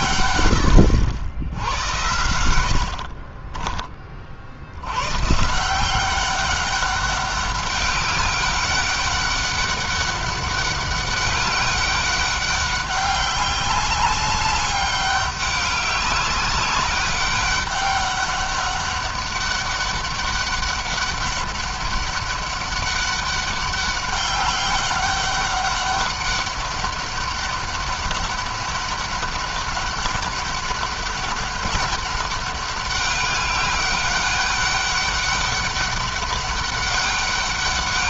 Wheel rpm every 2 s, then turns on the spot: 100, 80, 90, 200, 200, 200, 200, 200, 200, 200, 200, 200, 200, 200, 200, 200, 200, 200, 200.
2-4